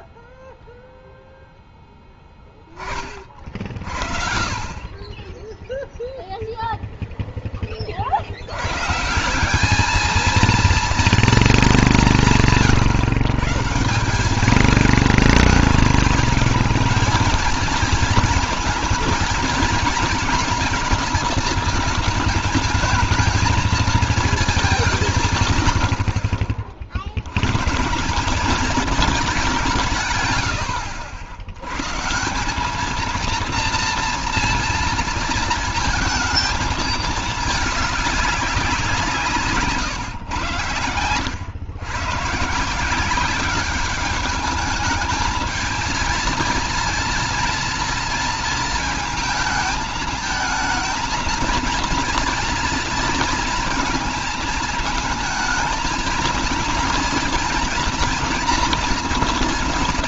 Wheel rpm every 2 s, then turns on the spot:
0, 20, 20, 0, 130, 230, 140, 210, 220, 230, 220, 220, 190, 50, 200, 90, 210, 230, 220, 190, 110, 170, 220, 230, 230, 220, 230, 220, 230, 230.
none